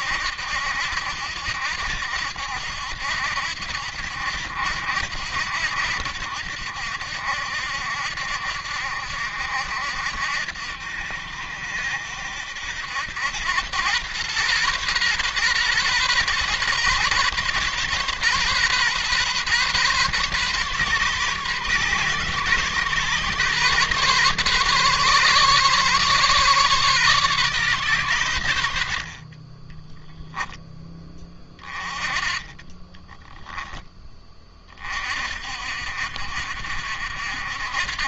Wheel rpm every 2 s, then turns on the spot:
80, 80, 80, 70, 70, 70, 90, 130, 130, 130, 130, 130, 140, 140, 50, 10, 20, 40, 60.
32-34